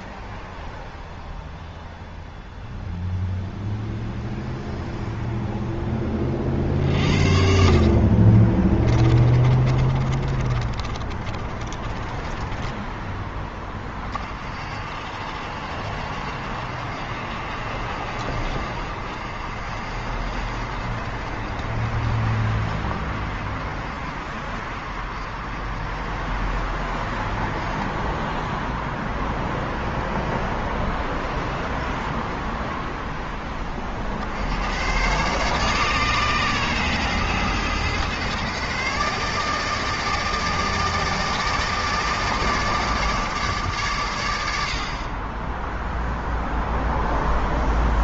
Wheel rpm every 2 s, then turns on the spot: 0, 0, 0, 50, 30, 30, 10, 60, 60, 50, 50, 50, 50, 50, 0, 0, 0, 100, 130, 140, 160, 150, 60, 0.
8-14